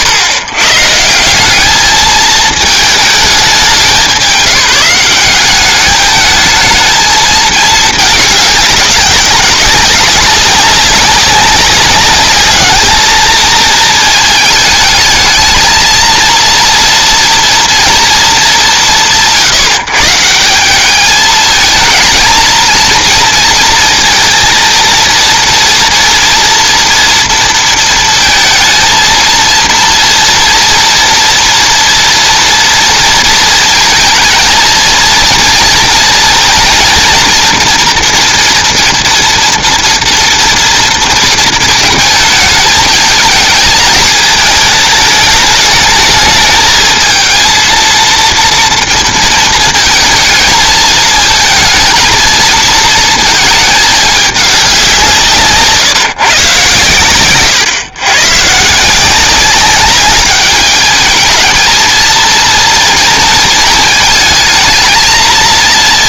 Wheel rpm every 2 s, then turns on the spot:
110, 220, 180, 220, 200, 190, 210, 220, 230, 150, 200, 220, 230, 230, 220, 240, 230, 230, 240, 230, 230, 220, 210, 220, 230, 220, 230, 190, 130, 150, 210, 230, 220.
none